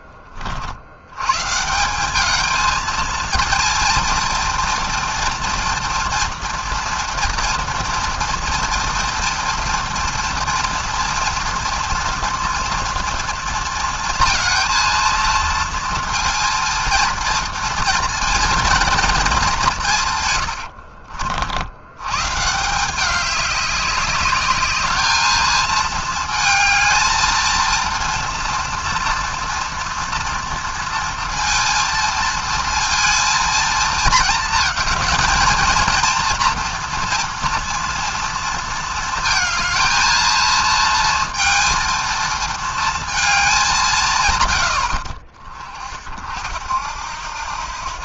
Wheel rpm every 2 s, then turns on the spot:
70, 220, 230, 230, 230, 230, 230, 230, 230, 230, 70, 170, 210, 220, 230, 230, 230, 220, 230, 230, 230, 230, 110, 70.
20-22